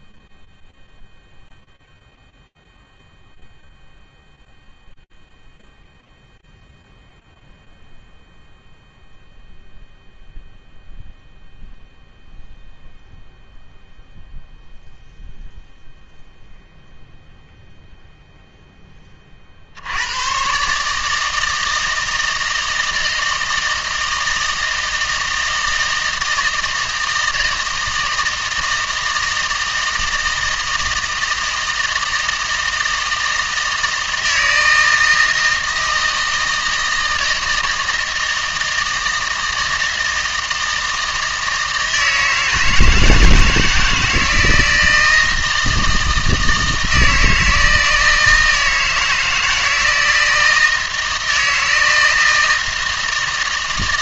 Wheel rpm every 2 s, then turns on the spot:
0, 0, 0, 0, 0, 0, 0, 0, 0, 10, 140, 160, 160, 160, 160, 160, 160, 160, 160, 160, 160, 160, 160, 160, 160, 160, 160.
none